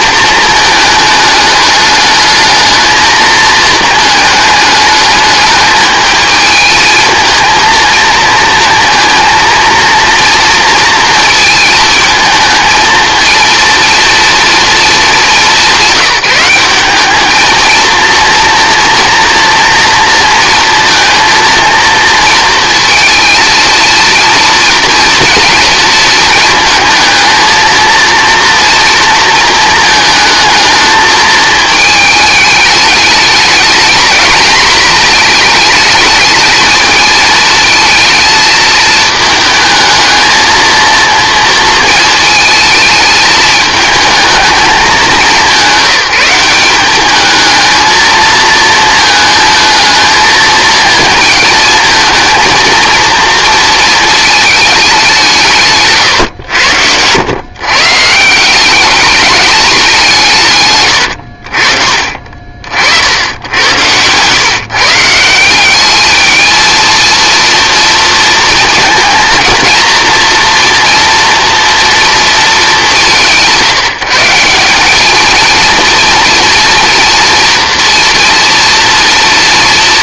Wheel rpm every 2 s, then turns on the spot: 220, 220, 210, 220, 230, 230, 220, 230, 190, 230, 230, 230, 240, 220, 230, 220, 210, 230, 220, 220, 230, 220, 210, 190, 220, 220, 230, 210, 100, 190, 130, 50, 140, 220, 230, 230, 210, 190, 230, 230.
none